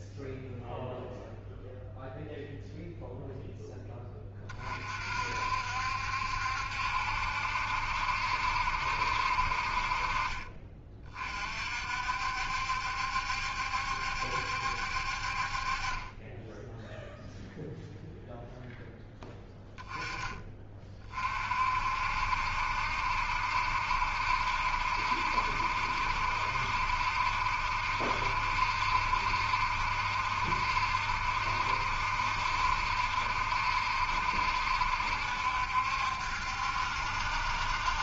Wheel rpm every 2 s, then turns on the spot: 0, 0, 30, 70, 70, 30, 70, 60, 0, 0, 30, 60, 70, 70, 70, 70, 70, 70, 70.
none